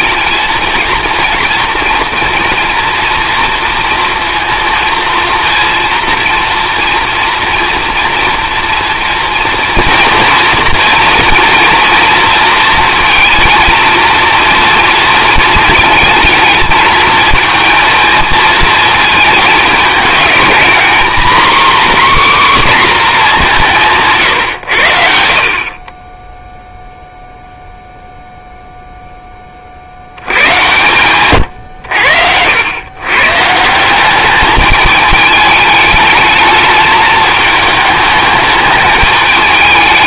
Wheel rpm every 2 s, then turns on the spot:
230, 240, 230, 230, 230, 230, 230, 230, 220, 220, 230, 260, 100, 0, 0, 100, 100, 210, 220, 210.
none